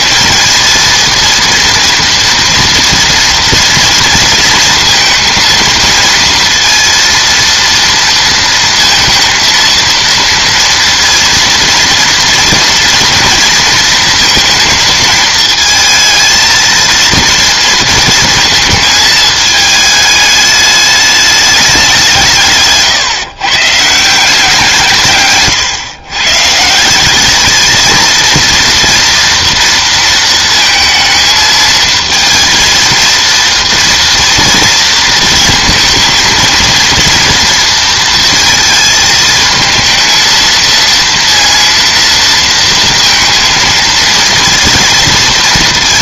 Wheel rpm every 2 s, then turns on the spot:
230, 230, 230, 230, 230, 230, 230, 230, 220, 220, 210, 160, 170, 160, 230, 220, 230, 230, 230, 220, 230, 230, 230.
none